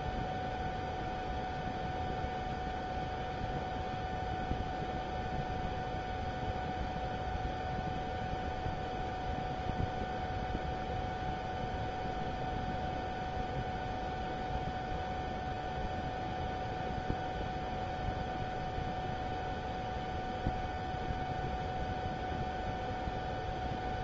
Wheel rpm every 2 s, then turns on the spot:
0, 0, 0, 0, 0, 0, 0, 0, 0, 0, 0, 0.
none